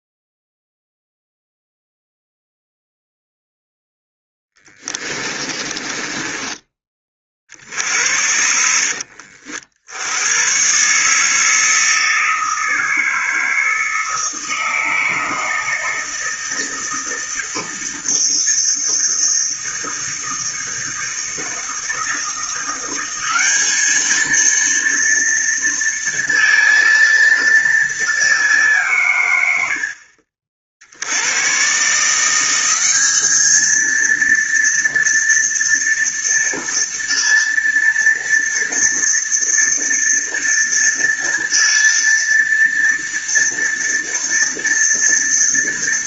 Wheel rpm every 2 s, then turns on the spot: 0, 0, 20, 20, 70, 130, 160, 160, 160, 160, 160, 180, 230, 230, 160, 70, 200, 230, 230, 230, 230, 230, 230.
4-6